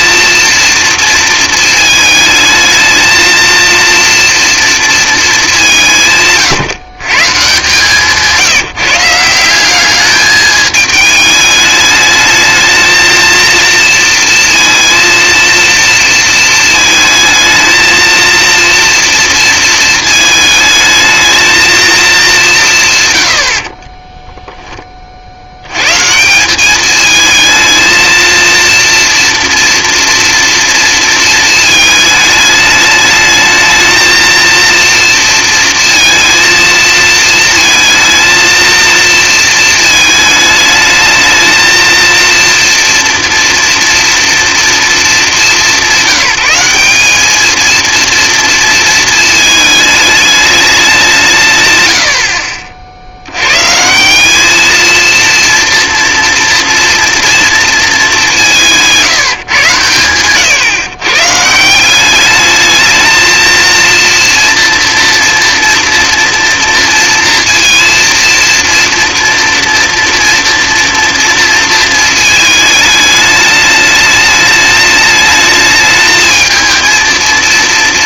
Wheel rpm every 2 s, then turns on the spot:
230, 220, 230, 150, 160, 210, 220, 230, 220, 230, 220, 160, 10, 200, 230, 230, 210, 230, 230, 230, 210, 230, 230, 190, 230, 200, 60, 230, 240, 170, 130, 210, 230, 230, 230, 230, 220, 210, 220.
none